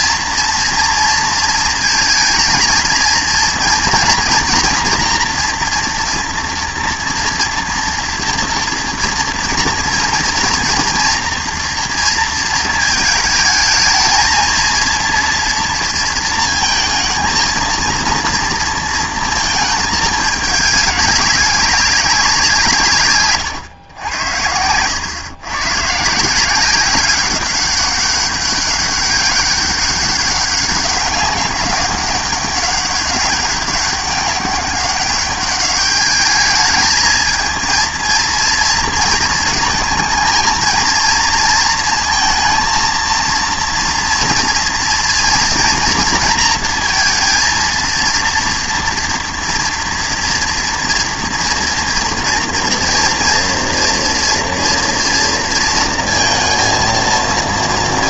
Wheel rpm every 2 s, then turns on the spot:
230, 230, 230, 230, 230, 230, 220, 220, 230, 230, 210, 180, 90, 180, 200, 200, 200, 190, 210, 230, 220, 230, 230, 230, 230, 230, 230, 230, 230.
24-26